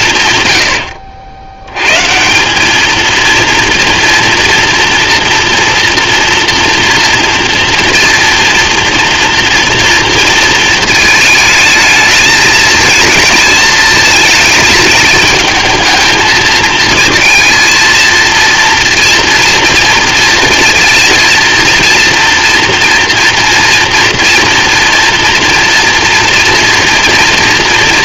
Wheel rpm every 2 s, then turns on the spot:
80, 230, 230, 230, 230, 220, 220, 220, 230, 240, 230, 230, 230, 230.
none